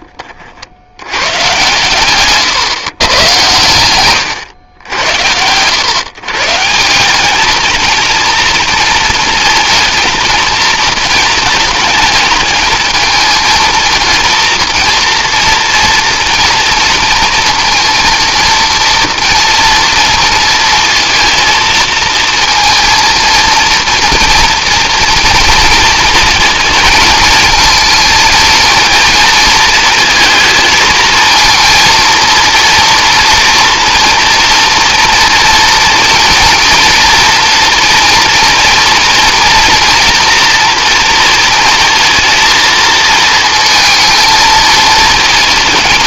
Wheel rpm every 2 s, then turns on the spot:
70, 130, 90, 160, 230, 230, 220, 230, 230, 230, 230, 230, 230, 230, 220, 230, 240, 240, 240, 230, 230, 230, 220.
none